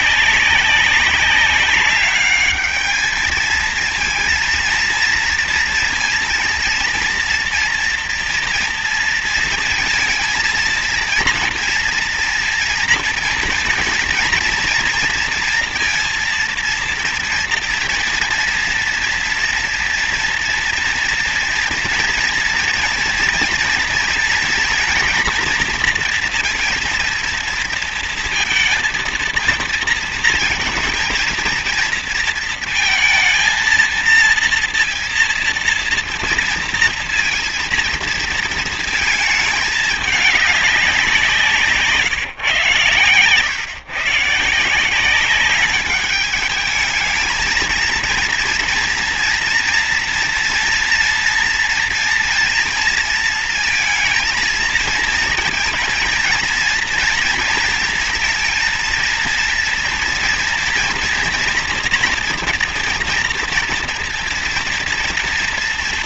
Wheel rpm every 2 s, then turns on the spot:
200, 210, 230, 230, 230, 230, 240, 230, 230, 230, 230, 230, 230, 230, 230, 220, 230, 230, 230, 220, 200, 120, 160, 220, 230, 230, 230, 230, 230, 230, 230, 240, 230.
none